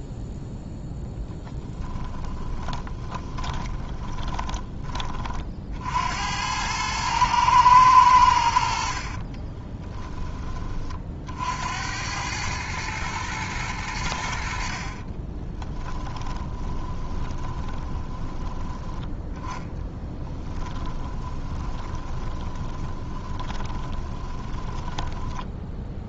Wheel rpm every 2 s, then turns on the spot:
0, 10, 20, 90, 80, 20, 100, 70, 20, 10, 10, 20, 20.
2-6 16-26